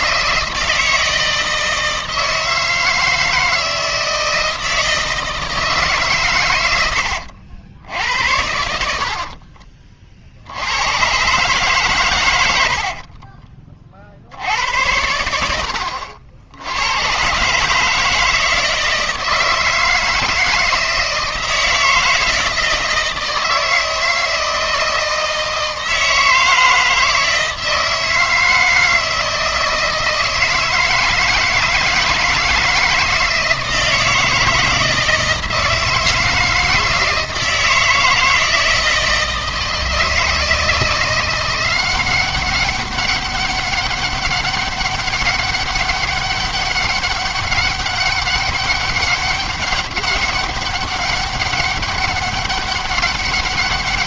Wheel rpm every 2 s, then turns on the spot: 160, 160, 160, 100, 70, 80, 80, 80, 90, 160, 160, 160, 160, 160, 160, 160, 160, 160, 160, 160, 160, 190, 200, 200, 200, 200, 200.
6-10 12-14